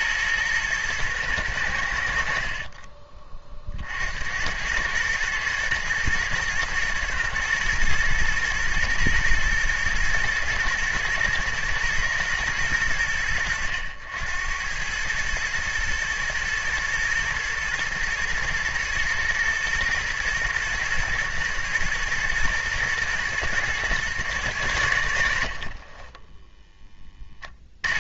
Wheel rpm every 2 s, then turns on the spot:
110, 40, 100, 120, 110, 110, 90, 100, 120, 110, 110, 120, 90, 10.
2-4